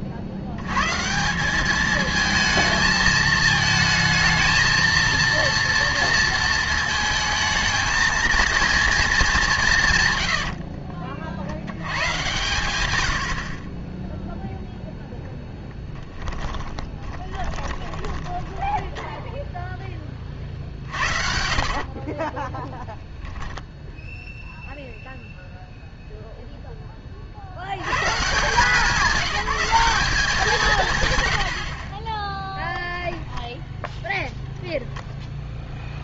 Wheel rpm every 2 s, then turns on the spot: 120, 220, 230, 220, 230, 50, 110, 0, 30, 10, 50, 10, 0, 10, 180, 170, 10, 0.
10-12 16-24 32-34